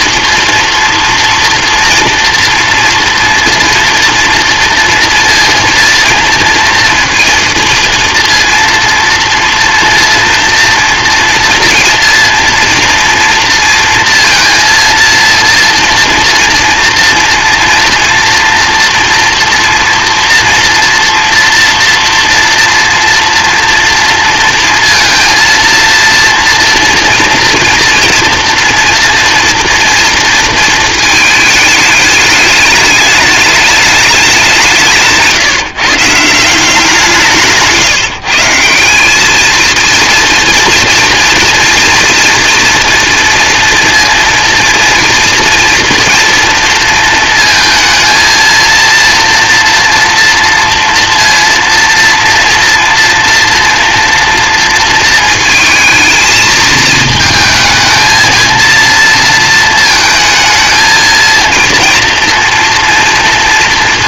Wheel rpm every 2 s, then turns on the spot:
230, 230, 230, 230, 230, 230, 230, 230, 230, 230, 230, 230, 230, 230, 230, 230, 210, 180, 180, 180, 230, 240, 230, 230, 230, 230, 230, 230, 220, 230, 220, 230.
none